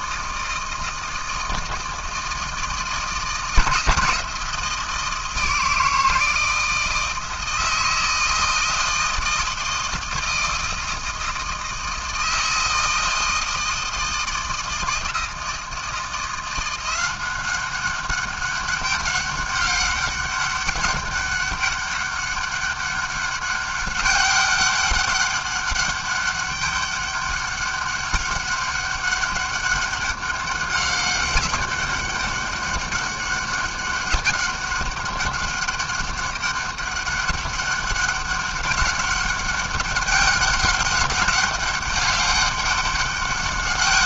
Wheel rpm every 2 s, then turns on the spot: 160, 150, 160, 160, 160, 160, 160, 160, 190, 200, 200, 200, 200, 200, 200, 200, 200, 200, 200, 200, 200, 200.
none